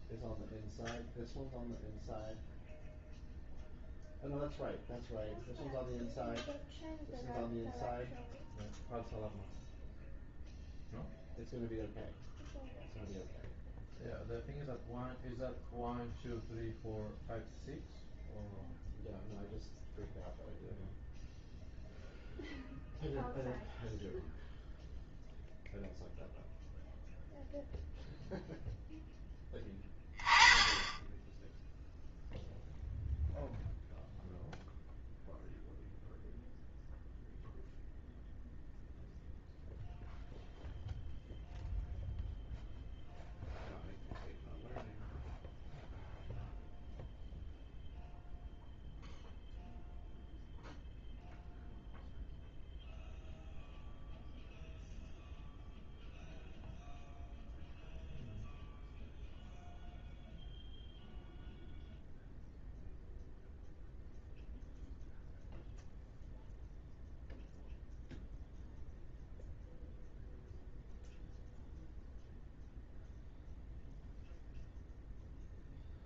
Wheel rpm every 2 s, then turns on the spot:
0, 0, 0, 0, 0, 0, 0, 0, 0, 0, 0, 0, 0, 0, 0, 10, 0, 0, 0, 0, 0, 0, 0, 0, 0, 0, 0, 0, 0, 0, 0, 0, 0, 0, 0, 0, 0, 0.
none